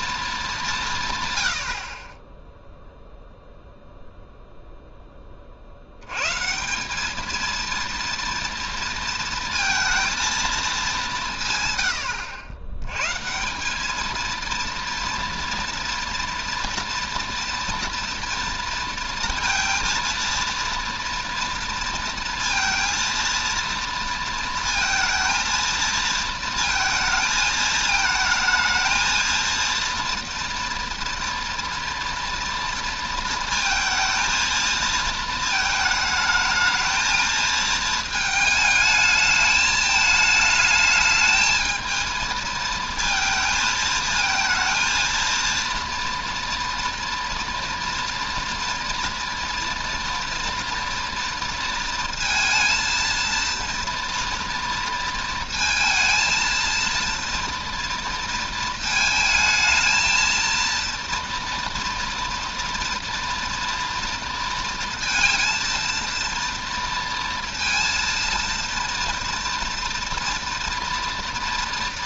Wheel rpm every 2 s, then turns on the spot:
180, 0, 0, 170, 230, 210, 90, 230, 230, 230, 230, 230, 230, 220, 220, 230, 230, 230, 220, 220, 220, 220, 230, 240, 230, 230, 230, 230, 230, 220, 230, 230, 230, 230, 230, 230.
none